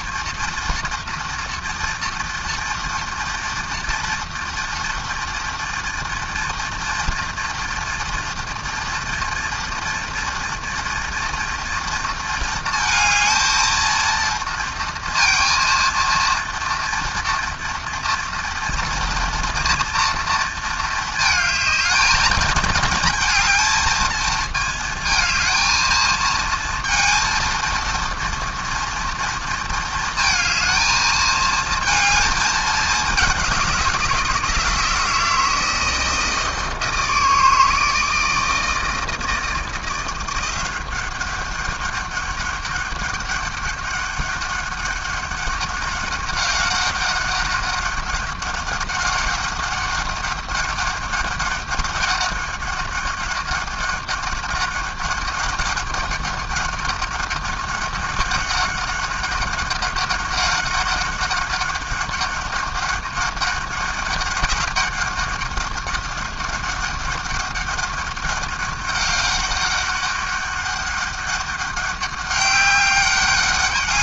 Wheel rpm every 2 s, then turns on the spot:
230, 230, 240, 230, 230, 230, 230, 230, 230, 230, 230, 220, 220, 230, 230, 220, 210, 170, 160, 160, 180, 200, 190, 200, 190, 190, 200, 200, 190, 190, 190, 200, 190, 190, 200, 200, 200.
none